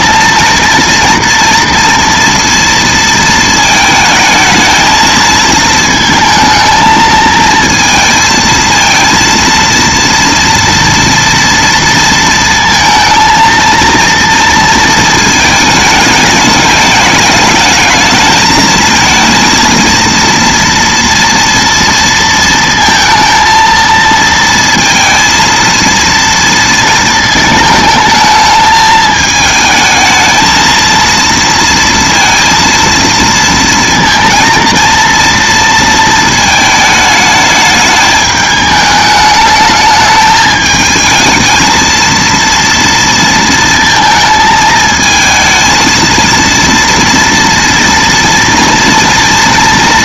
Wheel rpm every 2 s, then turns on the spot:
230, 230, 220, 220, 230, 240, 230, 230, 210, 220, 230, 230, 230, 230, 220, 230, 230, 230, 220, 210, 220, 230, 220, 230, 230.
none